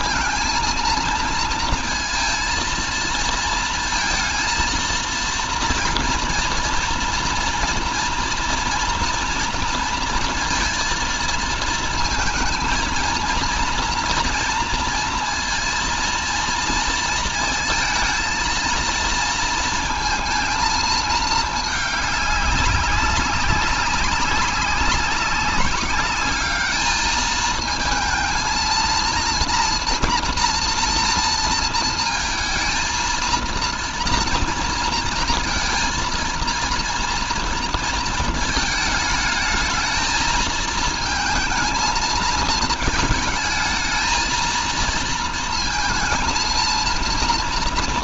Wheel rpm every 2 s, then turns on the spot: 230, 230, 230, 240, 230, 230, 220, 230, 230, 230, 230, 200, 190, 210, 230, 230, 230, 230, 230, 220, 220, 220, 230, 230.
none